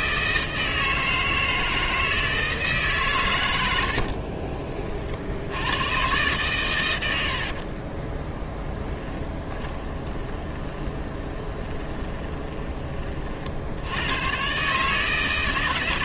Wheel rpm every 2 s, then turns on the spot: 160, 150, 40, 110, 10, 20, 30, 150.
8-12